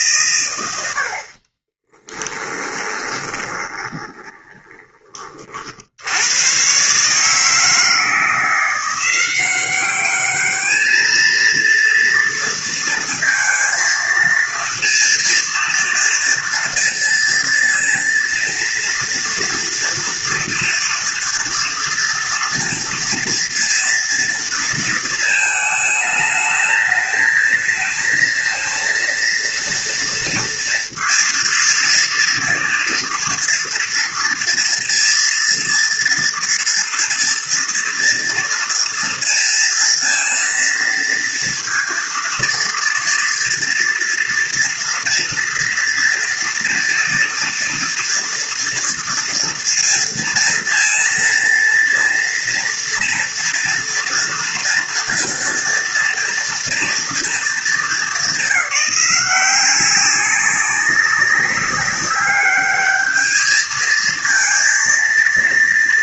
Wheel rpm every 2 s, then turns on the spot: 110, 20, 20, 120, 170, 210, 230, 230, 230, 230, 230, 230, 230, 220, 230, 230, 230, 230, 230, 230, 230, 230, 230, 240, 230, 230, 230, 230, 230, 200, 200, 210, 230.
2-6